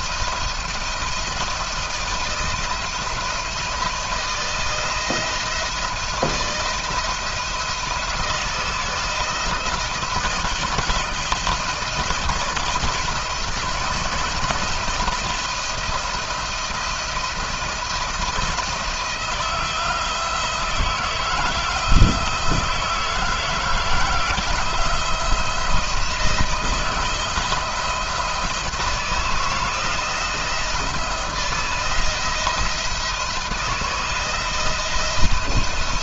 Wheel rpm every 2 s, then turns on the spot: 170, 160, 160, 170, 160, 170, 170, 170, 170, 170, 170, 160, 160, 170, 160, 170, 160, 160.
none